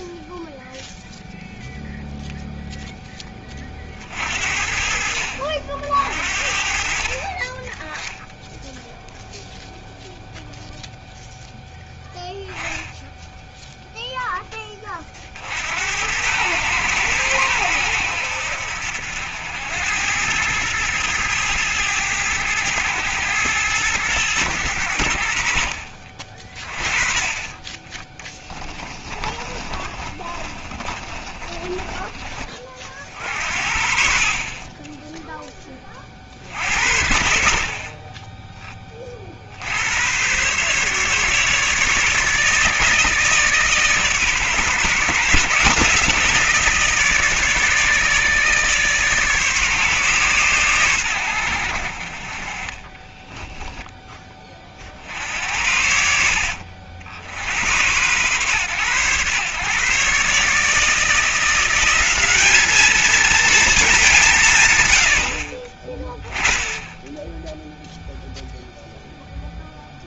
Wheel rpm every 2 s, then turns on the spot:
0, 0, 60, 50, 0, 0, 10, 30, 110, 80, 110, 100, 90, 20, 20, 30, 40, 10, 60, 30, 140, 150, 140, 160, 150, 110, 30, 60, 70, 120, 160, 220, 100, 10, 0.
28-32 52-54